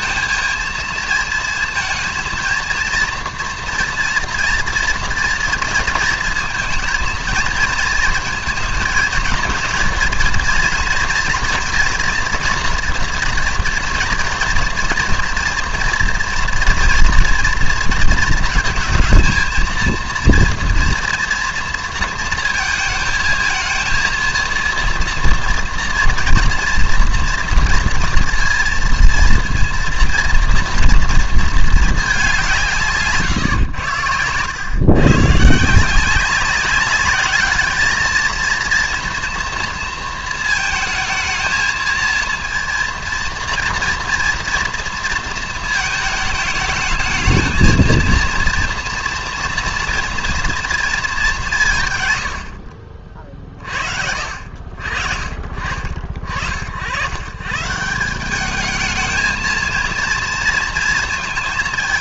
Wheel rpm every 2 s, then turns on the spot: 230, 230, 240, 230, 230, 230, 230, 230, 230, 220, 230, 230, 230, 230, 230, 230, 170, 120, 200, 230, 220, 230, 230, 220, 230, 230, 70, 50, 70, 210, 230.
none